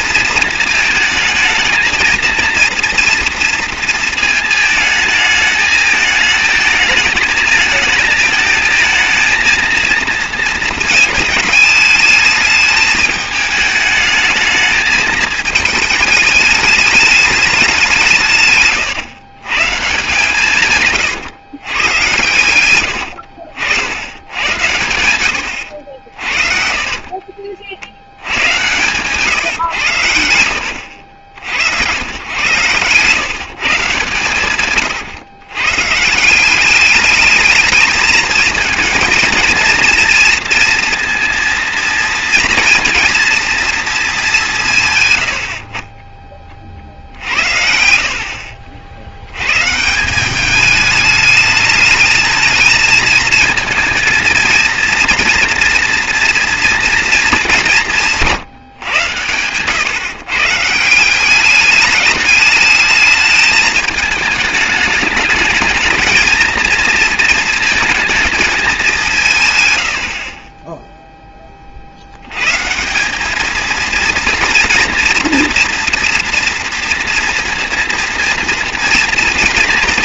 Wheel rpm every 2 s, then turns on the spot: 220, 230, 220, 220, 220, 220, 210, 220, 210, 120, 140, 90, 100, 40, 120, 80, 130, 140, 190, 230, 230, 230, 150, 40, 60, 210, 220, 230, 230, 130, 150, 210, 210, 230, 210, 20, 150, 230, 230, 230.
18-20 26-28 32-36 58-60